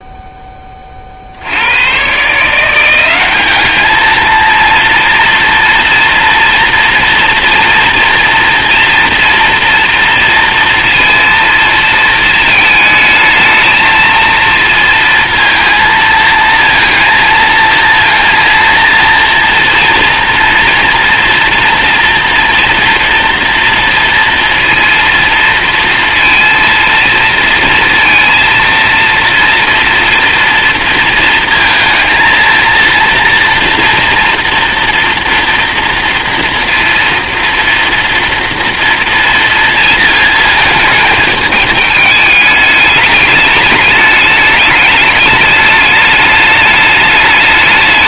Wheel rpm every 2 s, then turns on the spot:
30, 180, 230, 230, 230, 230, 220, 230, 230, 230, 240, 230, 230, 230, 230, 230, 230, 230, 230, 230, 220, 210, 210, 210.
none